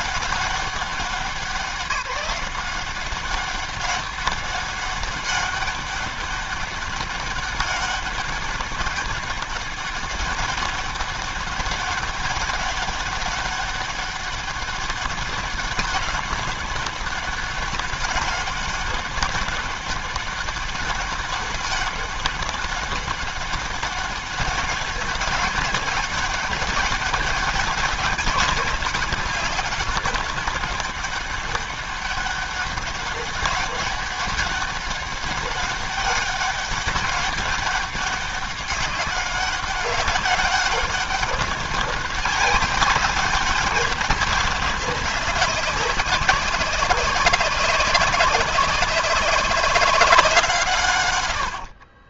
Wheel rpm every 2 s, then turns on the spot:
190, 190, 200, 200, 200, 200, 200, 200, 200, 200, 200, 200, 200, 200, 190, 200, 200, 200, 200, 190, 200, 190, 190, 190, 190, 110.
50-52